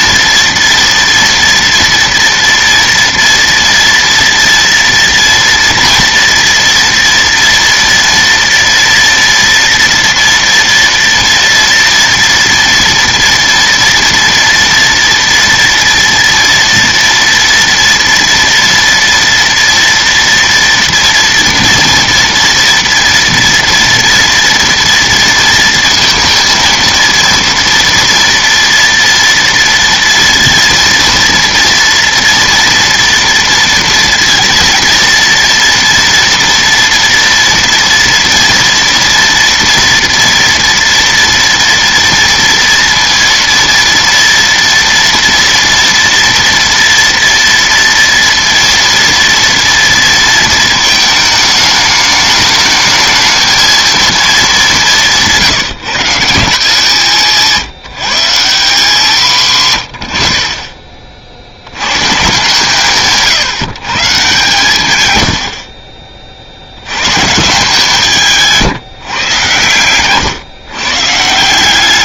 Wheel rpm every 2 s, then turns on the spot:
230, 230, 230, 230, 230, 230, 230, 240, 230, 230, 230, 230, 230, 230, 240, 230, 230, 230, 230, 230, 230, 230, 230, 230, 230, 220, 210, 210, 170, 170, 30, 150, 140, 60, 160, 130.
none